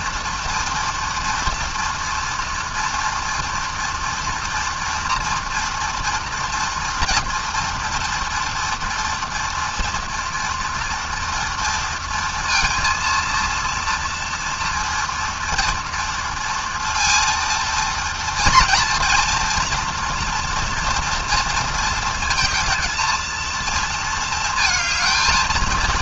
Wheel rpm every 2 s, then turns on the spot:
230, 240, 230, 230, 230, 230, 230, 230, 230, 230, 230, 230, 220.
none